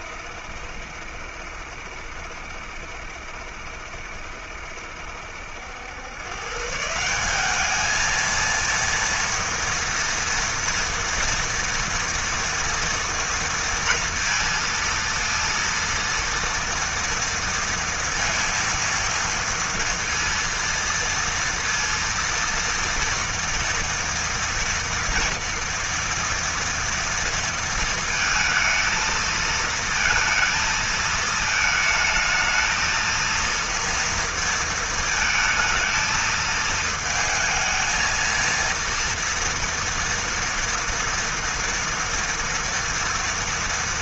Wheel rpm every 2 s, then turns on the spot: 70, 70, 70, 170, 230, 230, 230, 230, 230, 230, 230, 230, 230, 230, 230, 220, 230, 220, 220, 230, 230, 230.
none